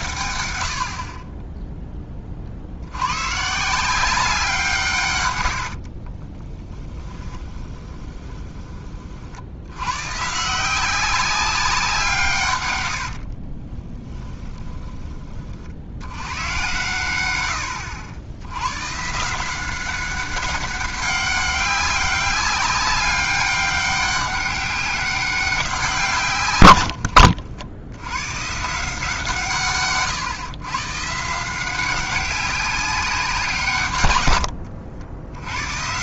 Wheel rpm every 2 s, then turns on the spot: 80, 80, 160, 20, 30, 170, 110, 30, 120, 110, 190, 200, 200, 100, 150, 130, 190, 70.
6-8 12-16